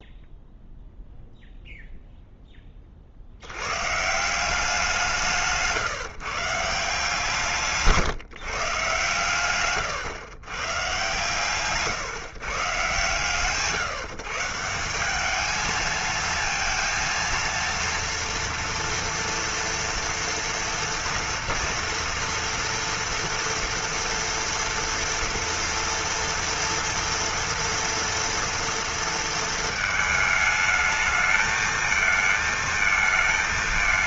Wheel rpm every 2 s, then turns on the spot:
0, 10, 170, 150, 150, 120, 140, 150, 230, 230, 230, 230, 230, 230, 230, 220, 220.
none